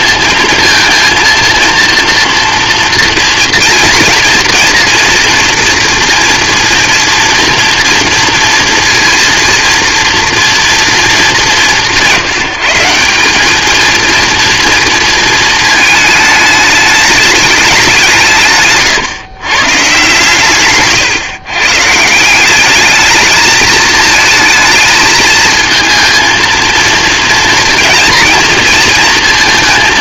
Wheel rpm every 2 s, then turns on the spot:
230, 230, 230, 230, 230, 220, 170, 230, 210, 130, 130, 210, 220, 230, 230.
none